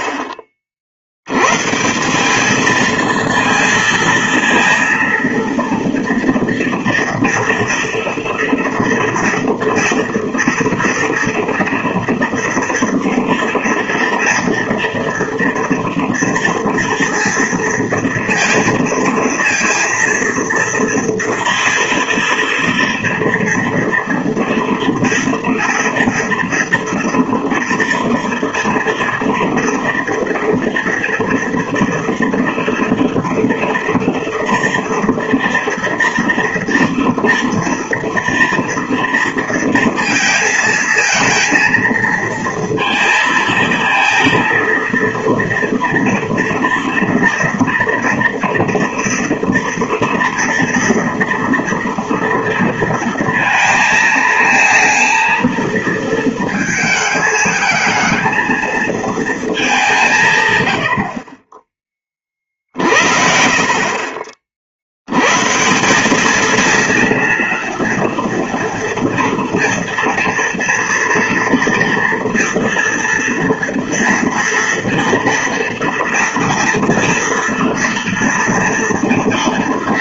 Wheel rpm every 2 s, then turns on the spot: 50, 220, 230, 230, 230, 230, 230, 240, 230, 230, 230, 230, 230, 230, 230, 230, 230, 230, 230, 230, 230, 230, 230, 230, 230, 230, 230, 230, 220, 230, 100, 50, 70, 230, 230, 230, 240, 230, 230, 230.
none